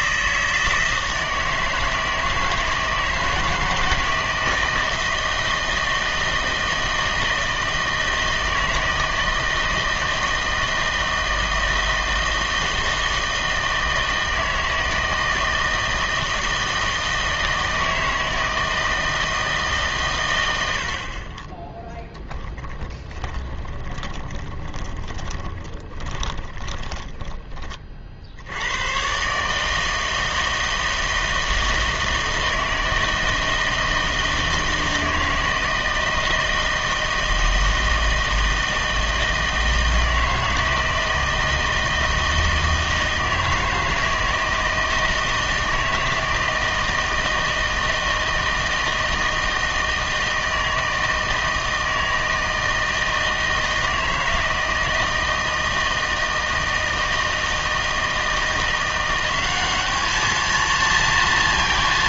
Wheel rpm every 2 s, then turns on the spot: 160, 160, 160, 160, 160, 160, 160, 160, 160, 160, 80, 10, 20, 10, 90, 160, 160, 160, 160, 160, 160, 160, 160, 160, 160, 160, 160, 160, 160, 170, 230.
22-28